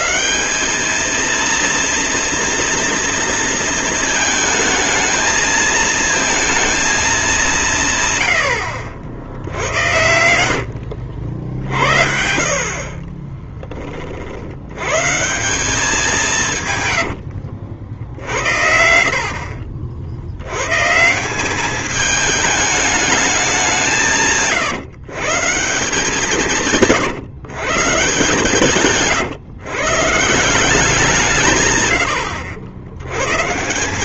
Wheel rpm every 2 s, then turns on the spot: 200, 230, 220, 220, 80, 70, 50, 120, 130, 60, 130, 210, 150, 160, 140, 170, 90.
10-12 16-20